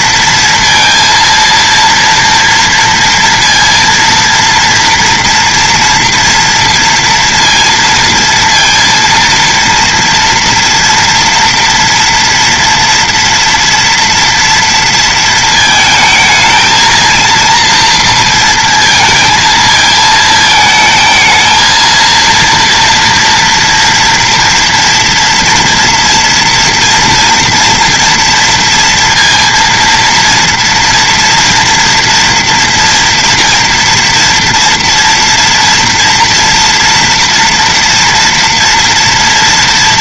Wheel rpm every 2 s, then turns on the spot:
230, 230, 230, 230, 230, 230, 230, 230, 220, 230, 220, 230, 230, 230, 230, 230, 230, 230, 240, 230.
none